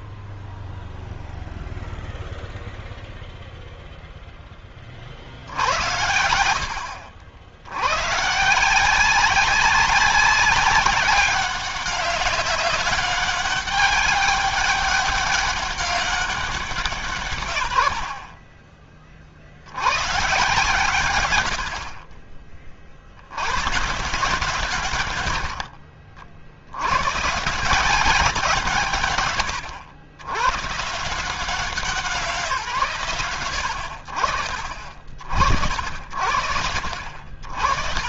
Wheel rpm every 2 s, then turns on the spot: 0, 0, 10, 60, 150, 190, 200, 200, 180, 30, 130, 30, 130, 60, 170, 120, 160, 60, 80.
none